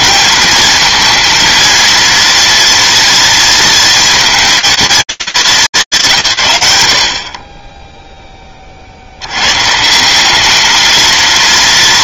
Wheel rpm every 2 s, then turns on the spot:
230, 230, 220, 110, 30, 210.
none